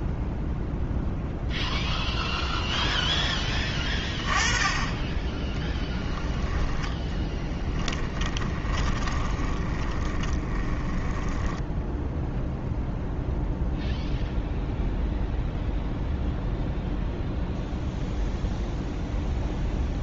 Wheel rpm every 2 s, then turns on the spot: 0, 0, 20, 10, 30, 10, 0, 0, 0, 0.
8-12